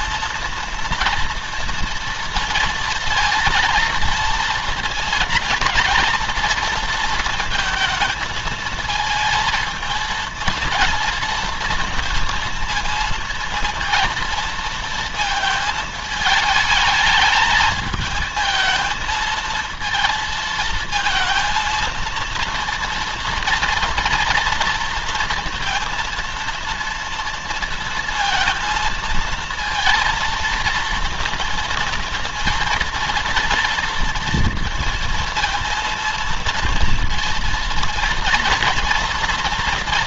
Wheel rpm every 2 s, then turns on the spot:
230, 230, 230, 230, 230, 230, 230, 230, 210, 220, 230, 230, 230, 230, 230, 230, 230, 230, 230, 230.
none